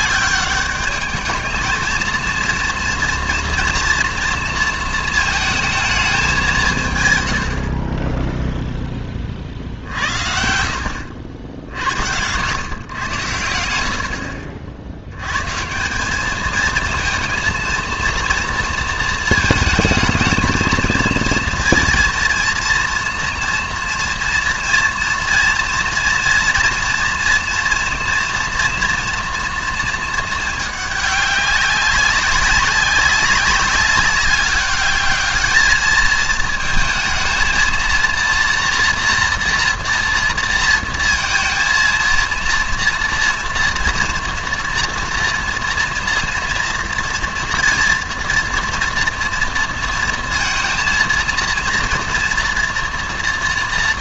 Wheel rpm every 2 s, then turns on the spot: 200, 240, 230, 160, 0, 70, 110, 60, 220, 230, 220, 230, 240, 230, 230, 220, 190, 200, 220, 230, 230, 230, 230, 230, 230, 230, 230.
none